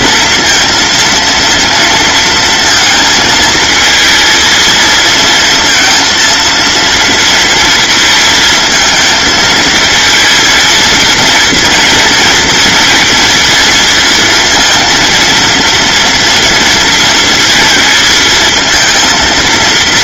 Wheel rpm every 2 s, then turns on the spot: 230, 230, 220, 230, 220, 230, 230, 230, 230, 230.
none